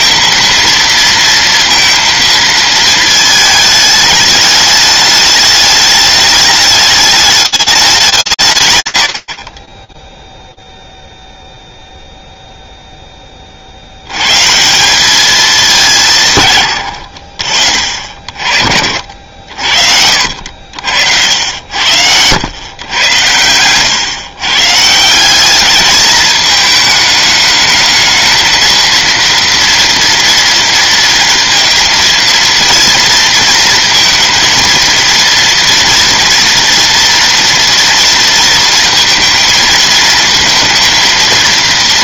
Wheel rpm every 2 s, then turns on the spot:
230, 220, 210, 210, 150, 0, 0, 150, 120, 40, 80, 100, 140, 210, 220, 230, 230, 230, 230, 230, 230.
20-22